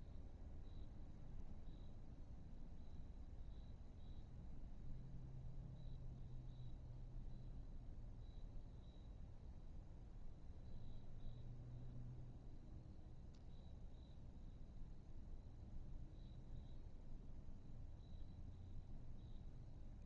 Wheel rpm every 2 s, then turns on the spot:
0, 0, 0, 0, 0, 0, 0, 0, 0, 0.
none